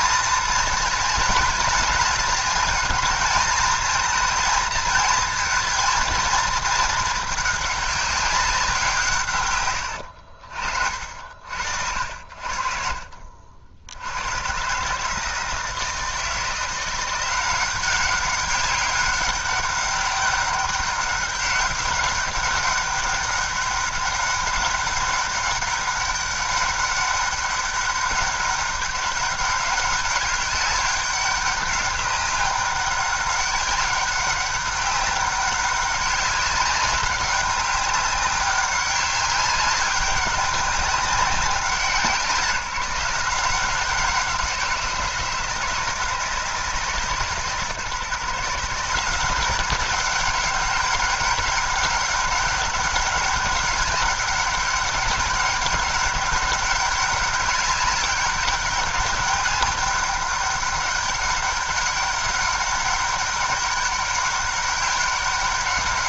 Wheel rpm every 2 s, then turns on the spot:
220, 220, 220, 220, 180, 50, 60, 130, 170, 200, 200, 200, 200, 200, 200, 200, 200, 200, 200, 200, 200, 160, 170, 150, 160, 190, 200, 200, 200, 200, 200, 200, 200.
none